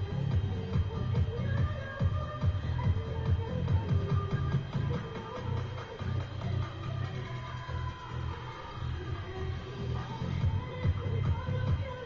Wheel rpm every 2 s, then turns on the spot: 0, 0, 0, 0, 0, 0.
none